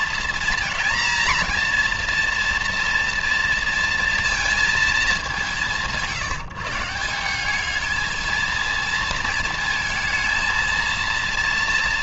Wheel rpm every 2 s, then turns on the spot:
240, 230, 180, 200, 230, 230.
none